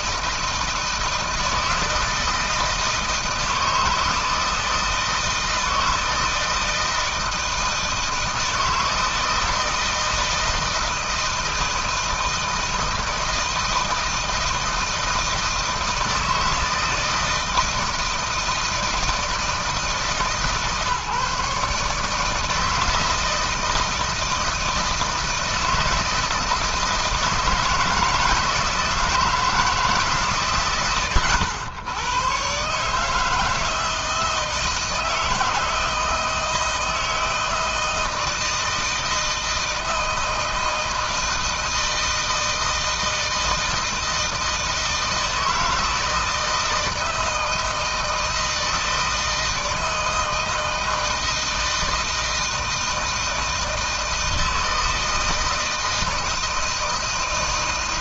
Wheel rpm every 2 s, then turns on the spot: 160, 160, 160, 160, 160, 160, 160, 160, 170, 160, 140, 160, 160, 160, 160, 120, 160, 160, 160, 160, 160, 160, 160, 160, 160, 160, 160, 160, 160.
none